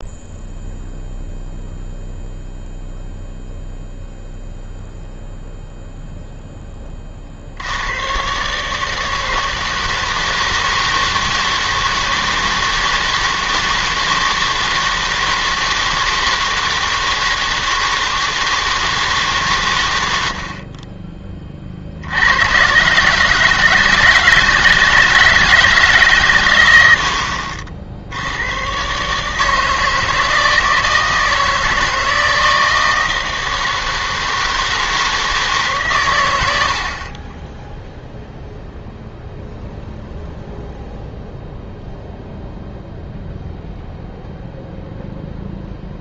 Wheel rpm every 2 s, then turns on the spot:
0, 0, 0, 10, 150, 160, 160, 160, 160, 160, 40, 120, 160, 110, 120, 160, 160, 160, 80, 0, 0, 0, 0.
none